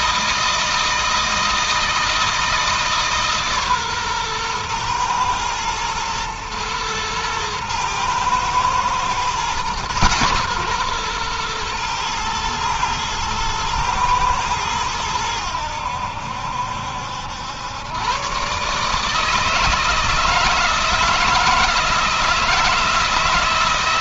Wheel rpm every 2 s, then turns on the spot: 160, 150, 120, 110, 120, 120, 110, 100, 80, 150, 160, 160.
none